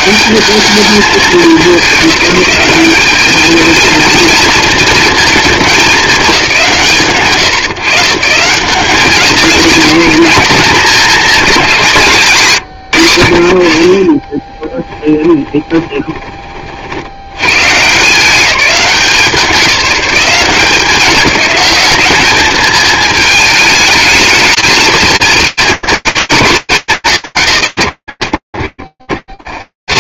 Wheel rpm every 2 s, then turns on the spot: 210, 210, 230, 150, 210, 200, 70, 10, 80, 180, 180, 220, 220, 210, 60.
14-16